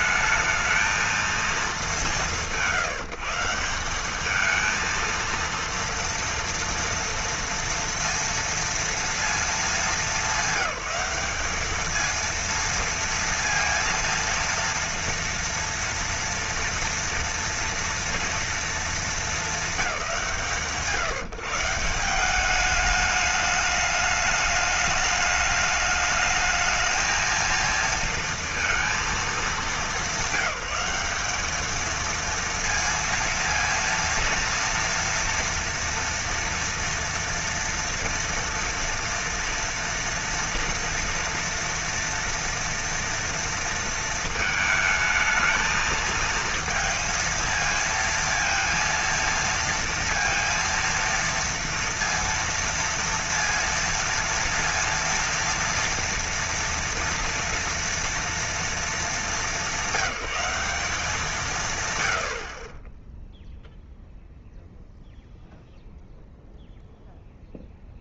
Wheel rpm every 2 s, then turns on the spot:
220, 160, 220, 230, 230, 200, 230, 230, 230, 230, 150, 210, 210, 220, 230, 200, 230, 230, 230, 230, 230, 230, 220, 230, 230, 230, 230, 230, 230, 230, 200, 40, 0, 0.
none